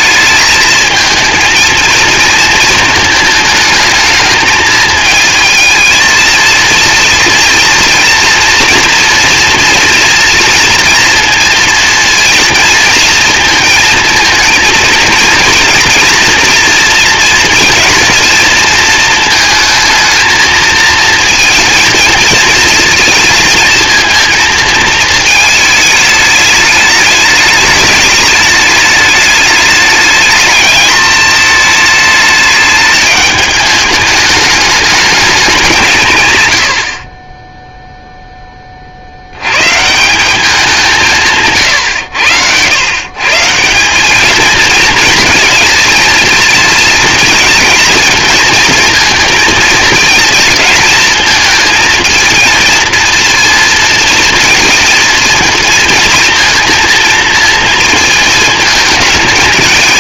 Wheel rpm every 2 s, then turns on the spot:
220, 220, 220, 230, 230, 230, 230, 220, 230, 230, 220, 230, 220, 210, 210, 210, 210, 210, 80, 40, 190, 100, 220, 220, 230, 220, 230, 230, 230, 220.
none